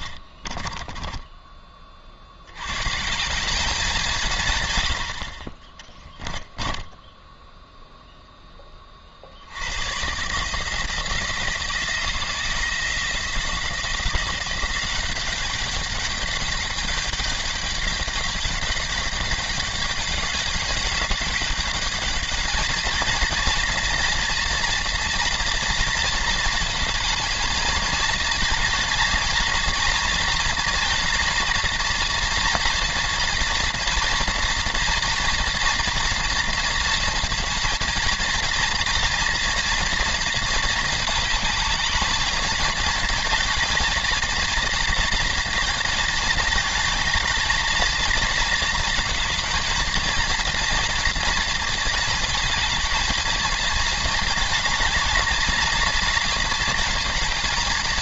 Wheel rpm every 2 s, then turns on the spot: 20, 100, 110, 10, 20, 160, 170, 190, 210, 200, 210, 220, 230, 220, 220, 230, 230, 230, 230, 230, 230, 230, 230, 220, 220, 230, 220, 210, 220.
0-2 6-8